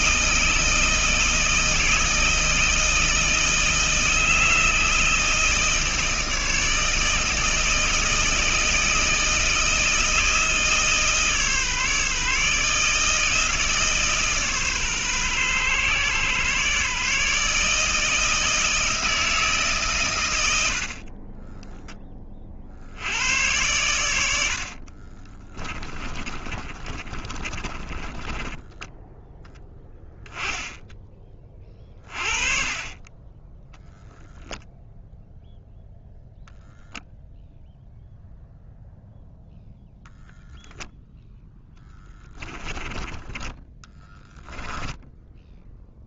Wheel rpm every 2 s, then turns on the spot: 160, 160, 160, 160, 160, 160, 150, 150, 130, 160, 90, 20, 70, 30, 20, 10, 30, 0, 0, 0, 0, 10, 10.
26-30 42-46